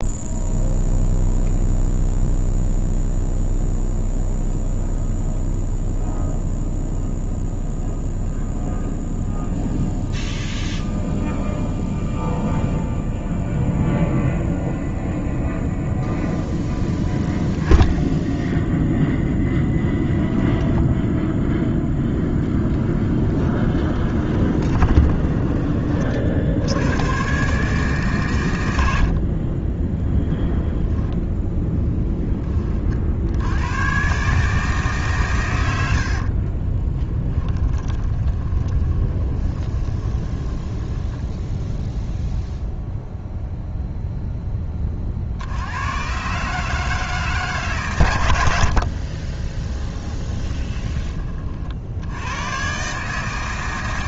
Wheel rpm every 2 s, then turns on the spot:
0, 0, 0, 0, 0, 0, 0, 0, 0, 0, 0, 10, 20, 90, 90, 0, 30, 150, 20, 20, 20, 0, 20, 150, 50, 30, 130.
24-26 36-42 48-50